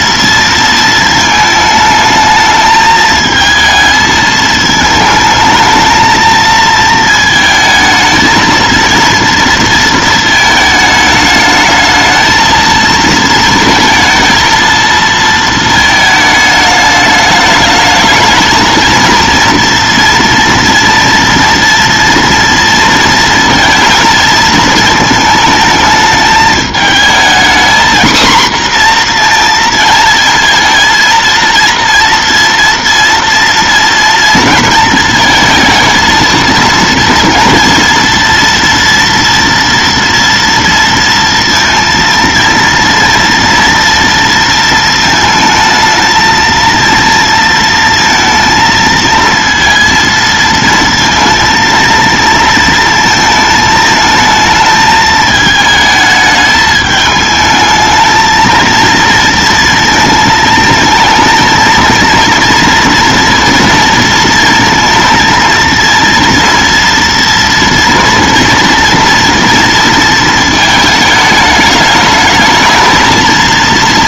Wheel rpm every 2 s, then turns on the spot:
230, 220, 220, 220, 230, 220, 220, 230, 210, 230, 230, 230, 220, 220, 240, 230, 230, 230, 230, 230, 230, 230, 230, 230, 230, 230, 230, 220, 210, 230, 220, 230, 230, 230, 230, 220, 220.
none